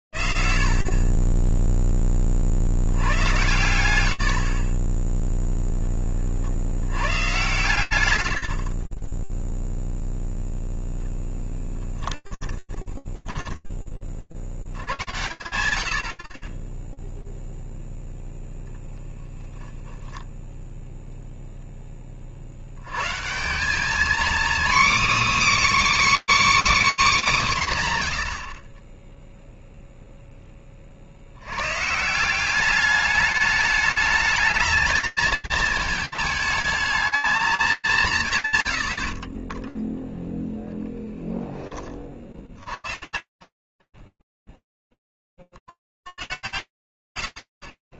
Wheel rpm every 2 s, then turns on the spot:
40, 10, 100, 0, 110, 0, 10, 40, 80, 0, 10, 30, 250, 310, 110, 0, 190, 220, 220, 150, 0, 70, 0, 100.
4-6 12-14